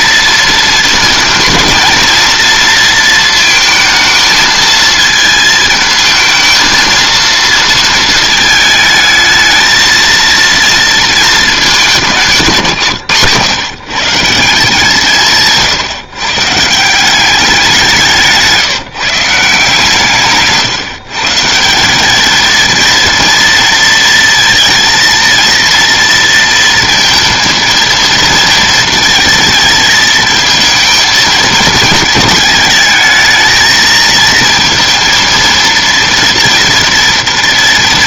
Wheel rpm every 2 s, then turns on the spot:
230, 230, 220, 220, 220, 230, 160, 170, 140, 150, 140, 220, 230, 230, 230, 230, 220, 220, 230.
none